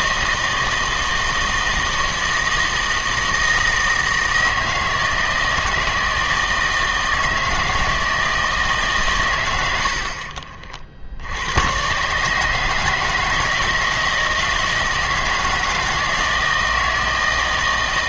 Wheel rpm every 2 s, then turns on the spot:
160, 160, 160, 160, 150, 50, 160, 160, 160.
none